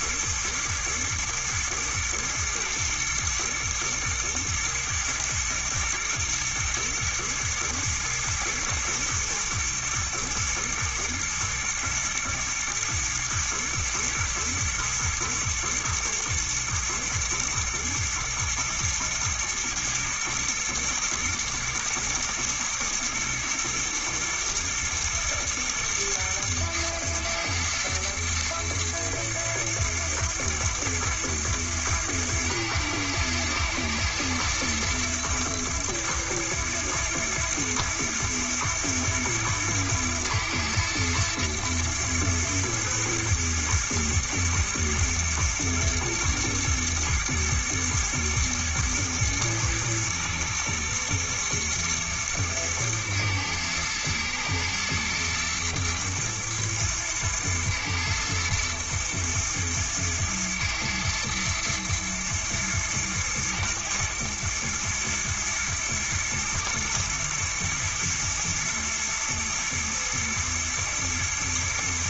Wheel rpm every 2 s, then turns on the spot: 120, 110, 110, 120, 110, 120, 120, 110, 110, 120, 120, 120, 120, 110, 110, 120, 110, 120, 120, 110, 110, 120, 110, 110, 110, 120, 110, 120, 110, 110, 110, 110, 120, 110, 110, 120.
none